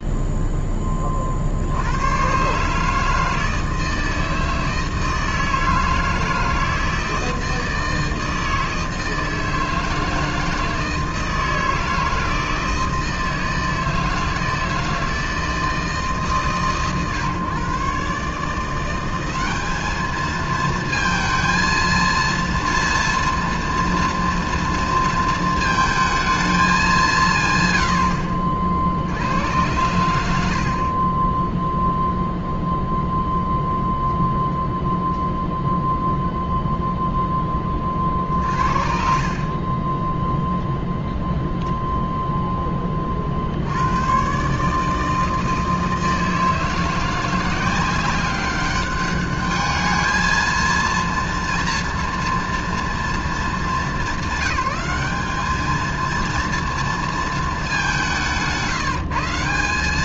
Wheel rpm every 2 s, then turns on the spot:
10, 140, 160, 160, 160, 160, 160, 160, 140, 160, 220, 230, 230, 220, 40, 50, 0, 0, 0, 50, 0, 0, 140, 160, 190, 220, 230, 190, 230, 180.
30-32 58-60